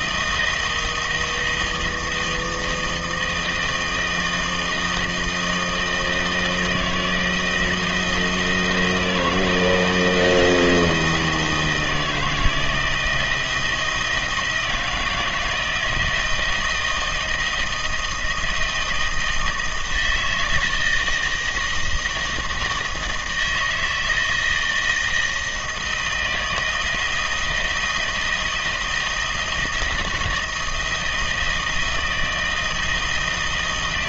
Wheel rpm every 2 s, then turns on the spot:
160, 160, 160, 160, 160, 160, 160, 160, 160, 160, 160, 160, 160, 160, 160, 170, 160.
none